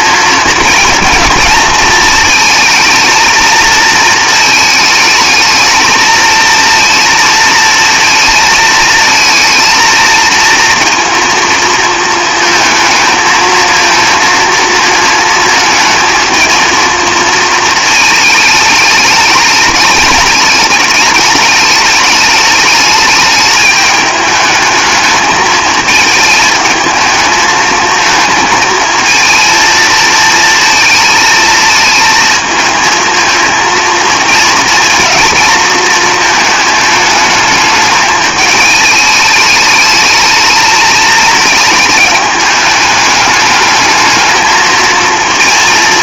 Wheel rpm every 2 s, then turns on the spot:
230, 220, 220, 230, 220, 230, 220, 230, 220, 220, 210, 210, 210, 220, 220, 220, 220, 230, 220, 210, 220, 210, 220.
none